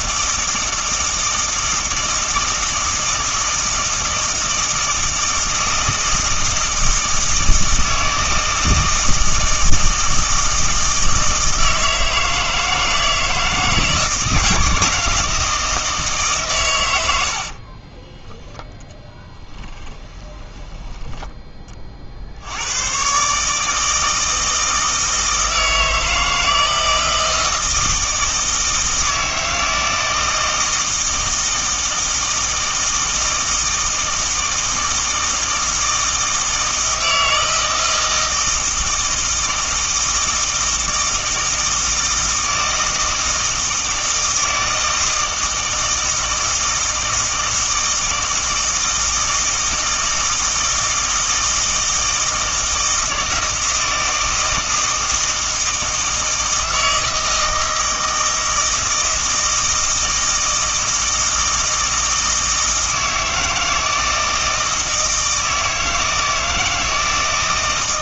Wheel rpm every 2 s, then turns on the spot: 160, 160, 160, 160, 160, 160, 160, 160, 120, 10, 10, 90, 160, 160, 160, 160, 160, 160, 160, 160, 160, 160, 160, 160, 160, 160, 160, 160, 160, 160, 160, 160, 160, 160.
20-22